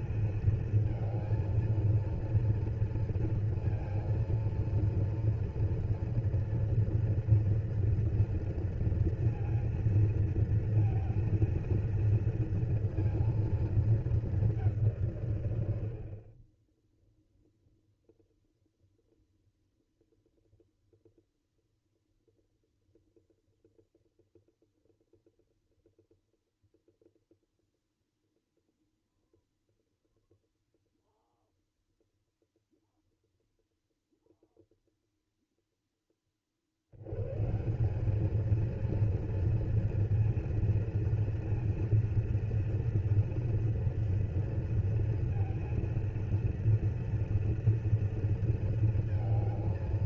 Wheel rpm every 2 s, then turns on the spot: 220, 230, 230, 230, 230, 230, 230, 190, 20, 0, 0, 0, 0, 0, 0, 0, 0, 0, 60, 220, 230, 230, 230, 230, 230.
none